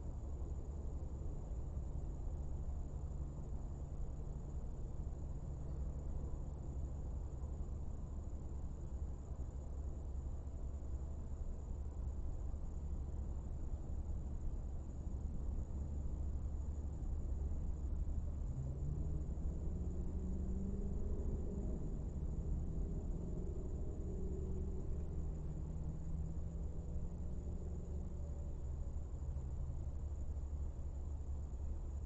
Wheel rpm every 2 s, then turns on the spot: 0, 0, 0, 0, 0, 0, 0, 0, 0, 0, 0, 0, 0, 0, 0, 0.
none